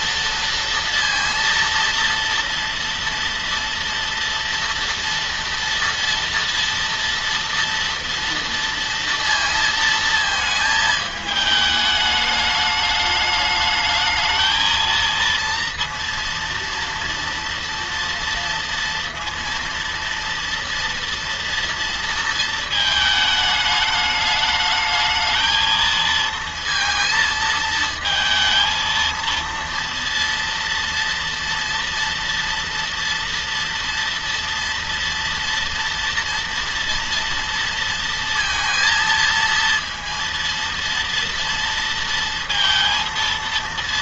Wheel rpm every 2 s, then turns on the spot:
230, 230, 230, 230, 230, 220, 210, 220, 230, 230, 230, 220, 210, 230, 230, 230, 230, 230, 230, 230, 230, 230.
none